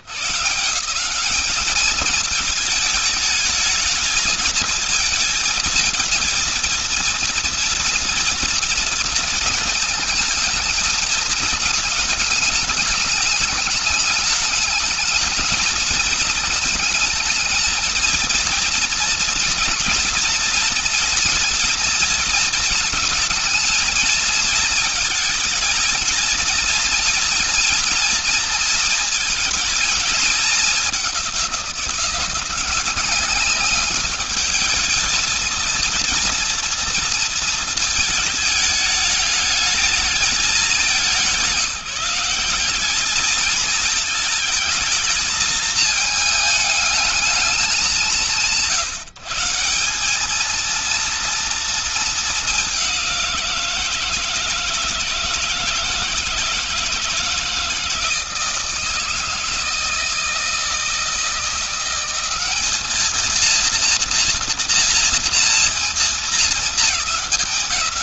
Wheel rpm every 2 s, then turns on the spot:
120, 220, 220, 220, 230, 220, 220, 210, 220, 230, 230, 230, 220, 230, 230, 220, 180, 210, 230, 220, 210, 180, 220, 220, 180, 200, 220, 160, 160, 160, 160, 190, 230, 230.
none